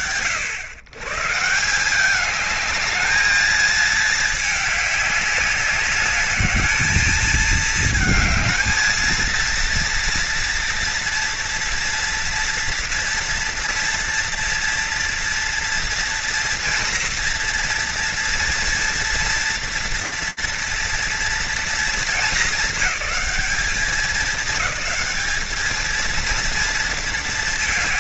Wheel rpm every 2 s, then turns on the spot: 120, 210, 200, 220, 230, 230, 230, 230, 230, 230, 230, 210, 210, 230.
none